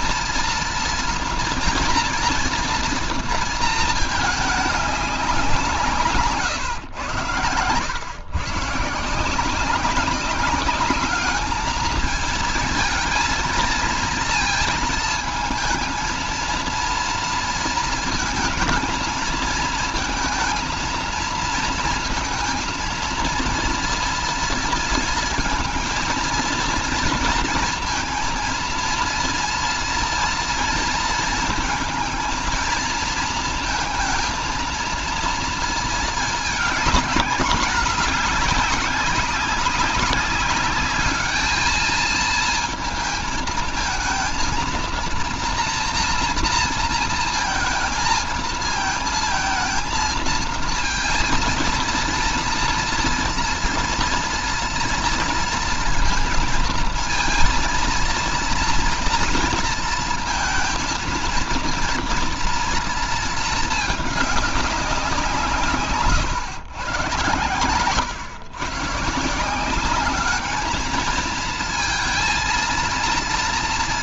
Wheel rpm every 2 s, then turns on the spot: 230, 230, 200, 120, 150, 210, 220, 220, 230, 230, 230, 230, 230, 230, 230, 230, 230, 230, 210, 200, 210, 220, 230, 230, 230, 230, 230, 230, 230, 230, 230, 230, 190, 120, 140, 220, 230.
none